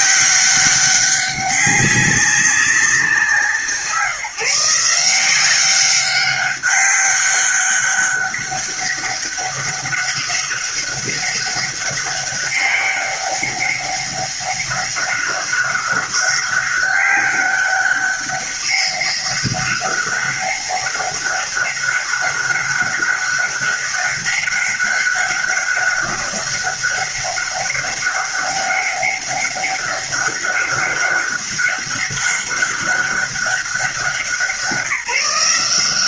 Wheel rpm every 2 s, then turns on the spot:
180, 200, 160, 200, 200, 200, 200, 200, 200, 200, 200, 200, 200, 200, 200, 200, 200, 170.
none